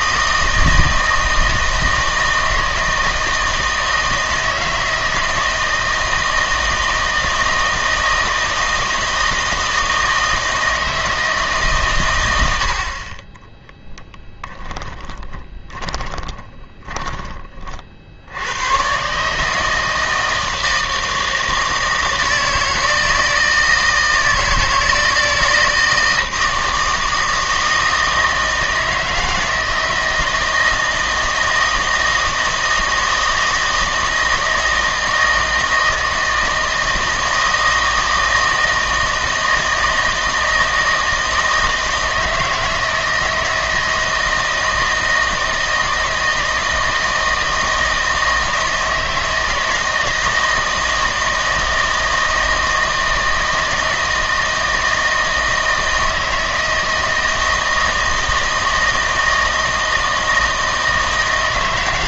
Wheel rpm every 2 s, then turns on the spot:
160, 160, 160, 160, 160, 160, 70, 10, 20, 110, 160, 160, 160, 160, 160, 160, 160, 160, 160, 160, 160, 160, 160, 160, 160, 160, 160, 160, 160, 160, 160.
14-18